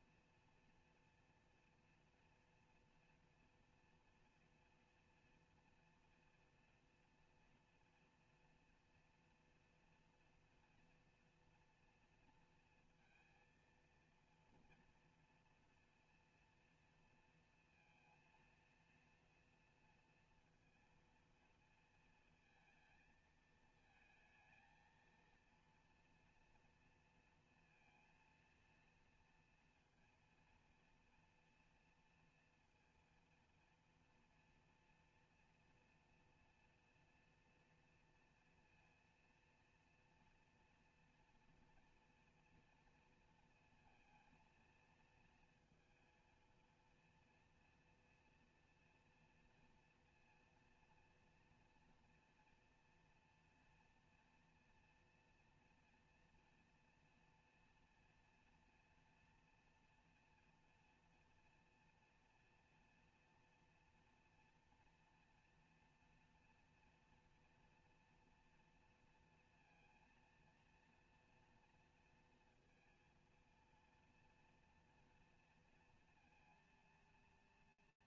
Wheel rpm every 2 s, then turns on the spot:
240, 230, 230, 240, 230, 230, 230, 230, 240, 230, 230, 230, 220, 230, 230, 230, 230, 230, 240, 230, 230, 230, 230, 230, 240, 230, 230, 230, 230, 230, 230, 230, 230, 230, 230, 230, 230, 230, 230.
none